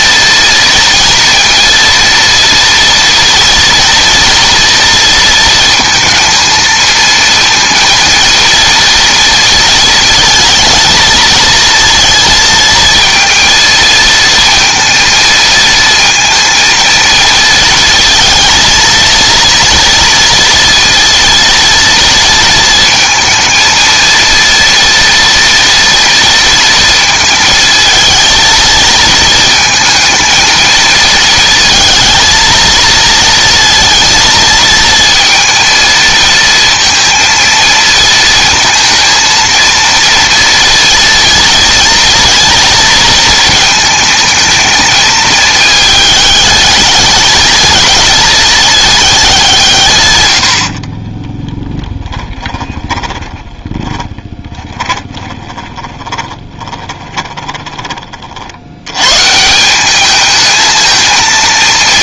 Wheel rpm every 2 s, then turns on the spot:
230, 230, 230, 230, 230, 220, 230, 230, 230, 230, 230, 220, 230, 230, 220, 230, 230, 220, 230, 230, 230, 230, 220, 210, 210, 50, 20, 20, 20, 100, 220.
50-58